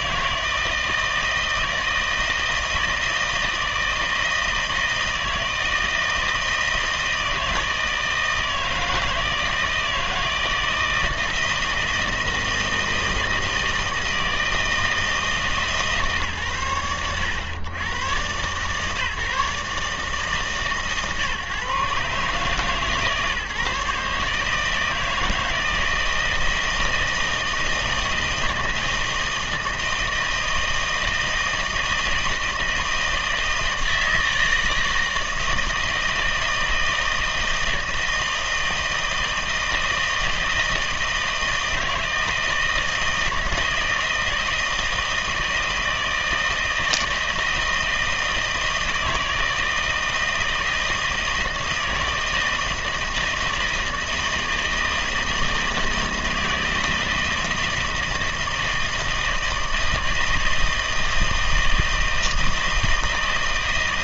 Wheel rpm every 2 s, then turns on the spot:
160, 160, 160, 160, 160, 160, 160, 160, 110, 140, 140, 150, 150, 160, 160, 160, 160, 160, 160, 160, 160, 160, 160, 160, 160, 160, 160, 160, 160, 160, 160, 160.
none